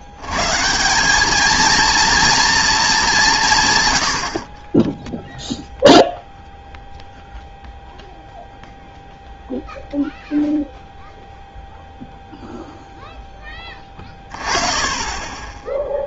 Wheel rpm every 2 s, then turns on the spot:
190, 220, 20, 0, 0, 0, 0, 20.
none